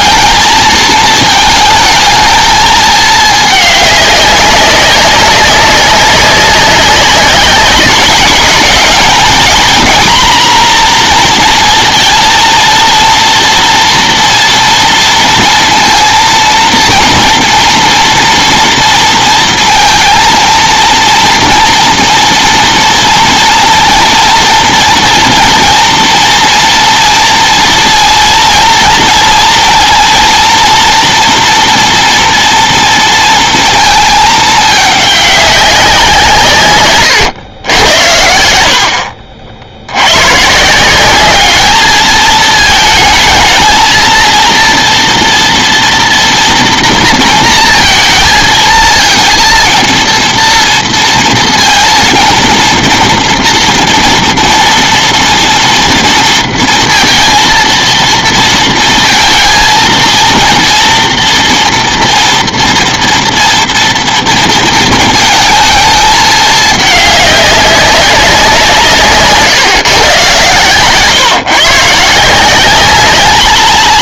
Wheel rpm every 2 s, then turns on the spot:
230, 220, 200, 190, 200, 250, 230, 240, 230, 230, 230, 230, 230, 230, 230, 230, 230, 210, 160, 70, 150, 220, 230, 230, 220, 230, 230, 230, 230, 230, 230, 230, 230, 210, 180, 130, 190.
none